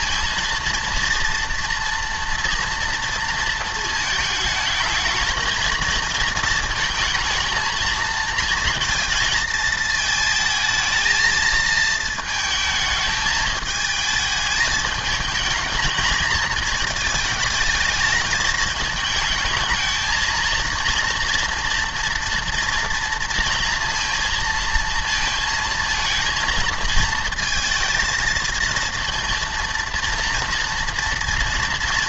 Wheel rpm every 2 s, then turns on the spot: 230, 230, 220, 230, 230, 220, 220, 220, 220, 210, 230, 230, 230, 230, 230, 230.
none